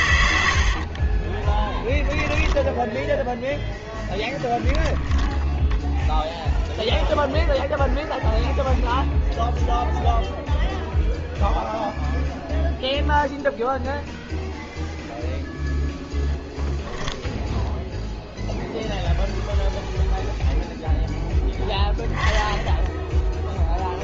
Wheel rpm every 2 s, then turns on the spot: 80, 10, 10, 0, 0, 0, 0, 0, 0, 0, 0, 10.
0-4